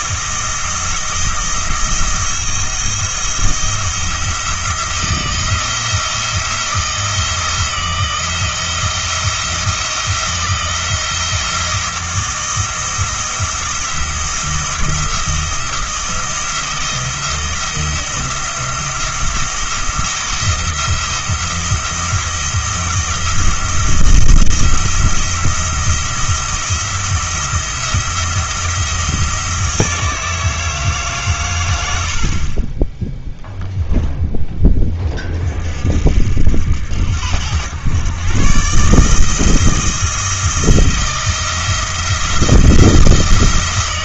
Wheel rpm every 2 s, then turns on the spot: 170, 170, 170, 170, 170, 170, 170, 170, 170, 170, 170, 170, 170, 170, 170, 160, 20, 20, 80, 140, 170, 170.
none